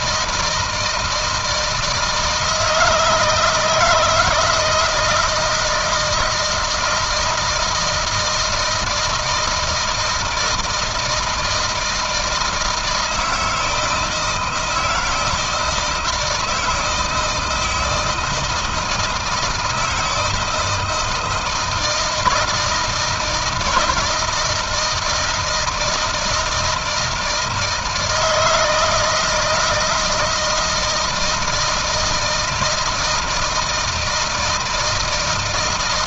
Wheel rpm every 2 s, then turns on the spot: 160, 160, 160, 160, 160, 160, 160, 160, 160, 160, 160, 170, 160, 160, 160, 160, 160, 160.
none